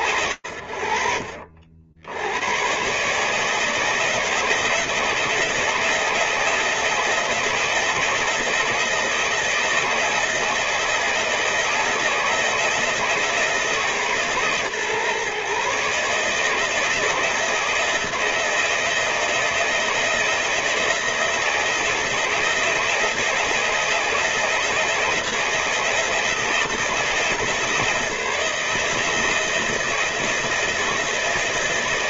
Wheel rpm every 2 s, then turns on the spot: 70, 160, 160, 170, 160, 160, 150, 150, 160, 170, 160, 170, 160, 150, 160, 160.
none